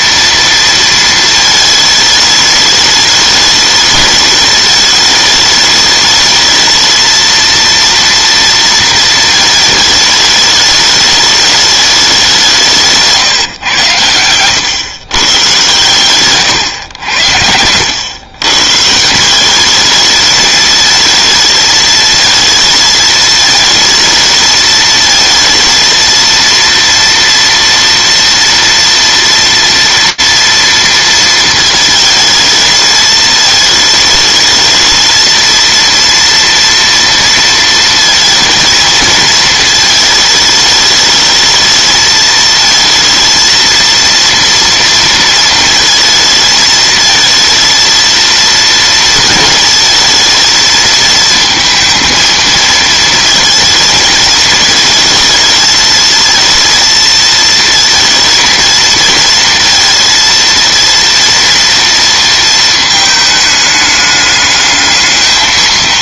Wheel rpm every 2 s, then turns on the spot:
230, 210, 210, 220, 230, 210, 160, 120, 120, 130, 220, 220, 220, 230, 230, 230, 220, 220, 230, 220, 220, 220, 230, 220, 230, 220, 220, 220, 230, 220, 230, 220, 210.
12-14 16-18